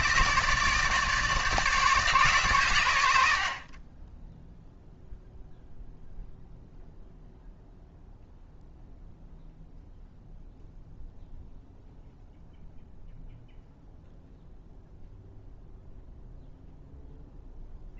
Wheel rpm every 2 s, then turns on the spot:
160, 100, 0, 0, 0, 0, 0, 0, 0.
none